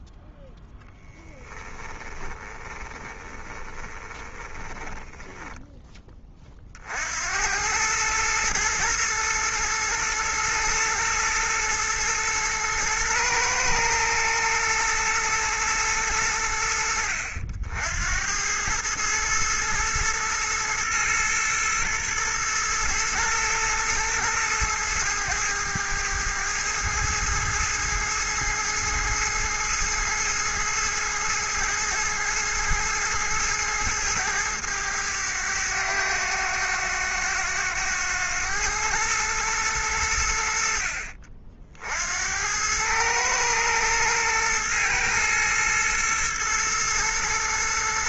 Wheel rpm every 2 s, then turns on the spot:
0, 20, 20, 40, 110, 110, 120, 120, 80, 100, 110, 120, 110, 110, 110, 110, 110, 110, 100, 110, 70, 100, 120, 120.
2-6